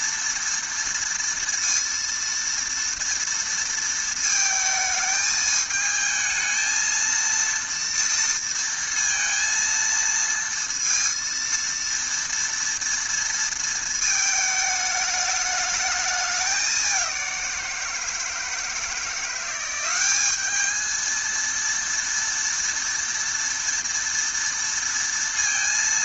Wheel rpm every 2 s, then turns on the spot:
230, 230, 220, 230, 230, 230, 230, 210, 190, 170, 220, 230, 230.
none